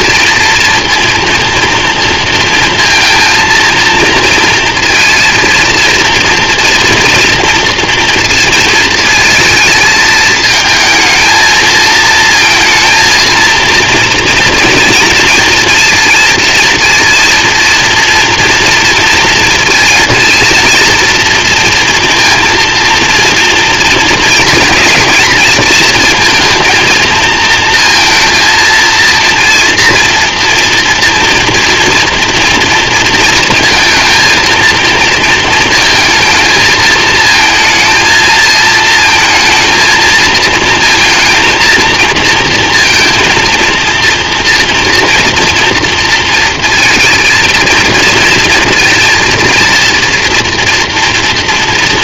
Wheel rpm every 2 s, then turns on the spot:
230, 230, 230, 230, 230, 220, 230, 230, 230, 230, 230, 230, 240, 230, 230, 230, 230, 230, 220, 220, 220, 230, 240, 230, 230, 230.
none